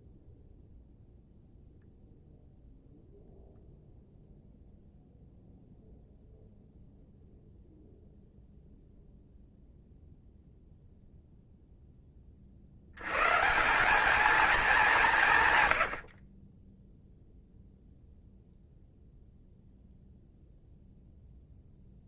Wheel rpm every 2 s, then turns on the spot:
0, 0, 0, 0, 0, 0, 100, 190, 0, 0, 0.
none